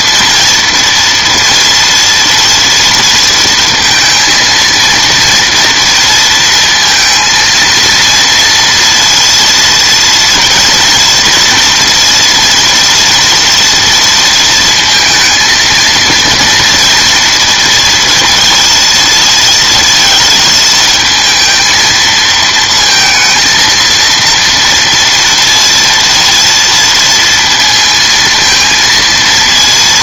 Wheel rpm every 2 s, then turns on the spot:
230, 230, 230, 230, 230, 240, 230, 230, 230, 230, 230, 230, 230, 230, 230.
none